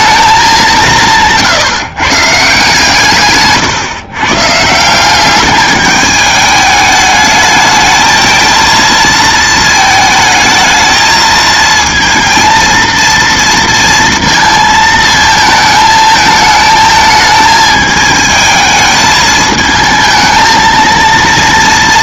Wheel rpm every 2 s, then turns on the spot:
180, 140, 160, 210, 230, 220, 230, 230, 220, 220, 230.
none